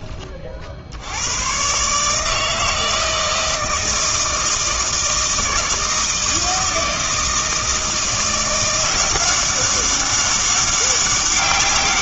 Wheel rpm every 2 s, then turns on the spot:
60, 160, 160, 160, 180, 200.
none